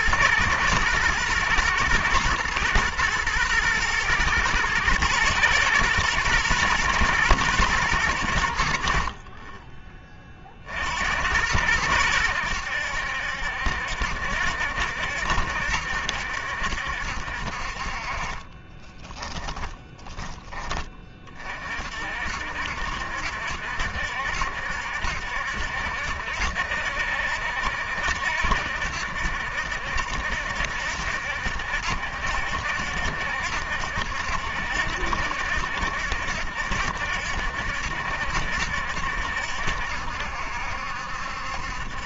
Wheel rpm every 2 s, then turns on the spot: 110, 120, 110, 120, 50, 70, 70, 70, 70, 20, 20, 70, 70, 60, 70, 70, 70, 70, 70, 70, 70.
18-20